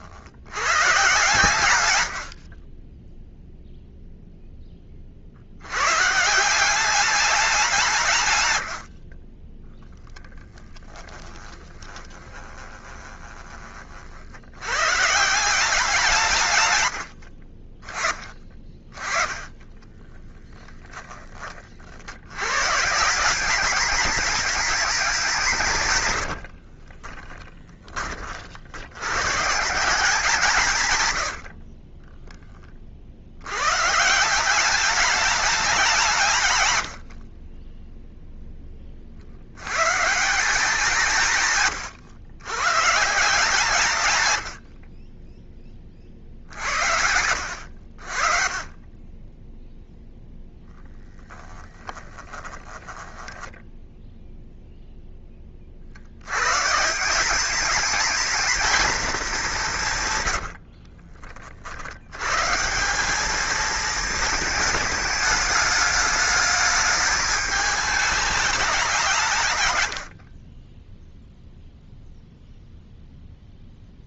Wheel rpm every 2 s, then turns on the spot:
130, 20, 20, 190, 60, 10, 30, 120, 90, 20, 10, 160, 200, 30, 100, 140, 50, 200, 80, 30, 180, 140, 40, 80, 30, 0, 10, 10, 170, 220, 40, 180, 210, 210, 180, 10, 0.
8-14 26-28 30-32 52-54 60-62